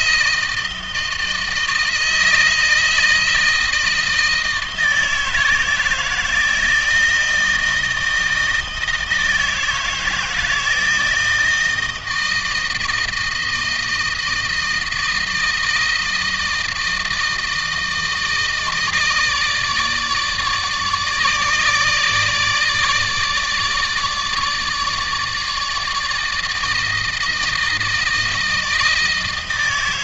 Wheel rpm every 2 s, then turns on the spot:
160, 160, 160, 160, 160, 160, 170, 160, 160, 160, 150, 150, 160, 160, 160.
none